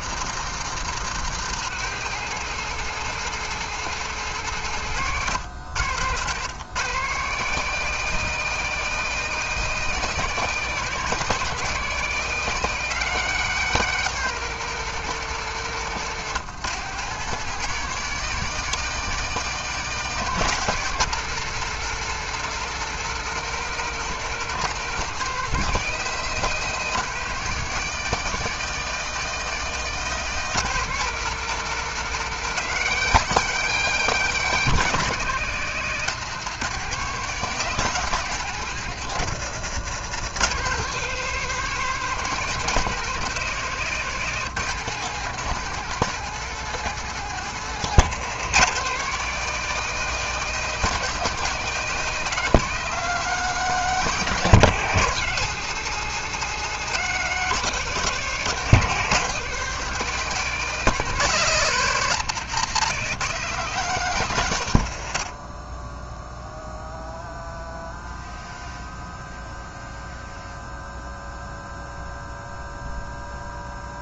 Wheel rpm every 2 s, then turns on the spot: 160, 180, 140, 150, 190, 180, 180, 180, 160, 180, 180, 180, 180, 180, 180, 180, 180, 170, 170, 160, 160, 170, 160, 170, 170, 180, 170, 160, 170, 160, 160, 160, 90, 0, 0, 0, 0.
none